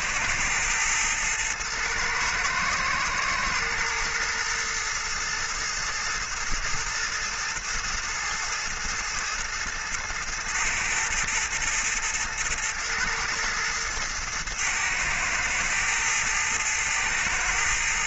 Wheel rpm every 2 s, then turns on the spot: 110, 110, 110, 110, 110, 110, 110, 110, 110.
none